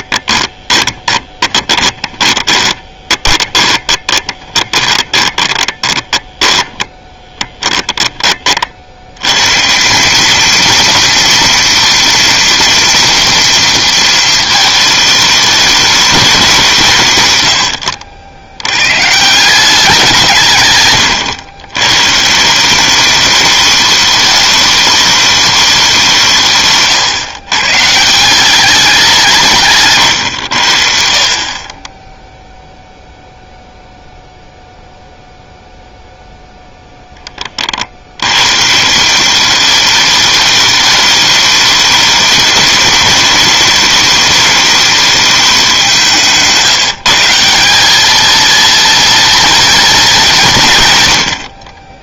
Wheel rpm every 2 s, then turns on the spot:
10, 20, 30, 10, 70, 230, 230, 220, 150, 120, 120, 190, 210, 140, 190, 60, 0, 0, 0, 150, 210, 210, 210, 170, 230, 130.
0-8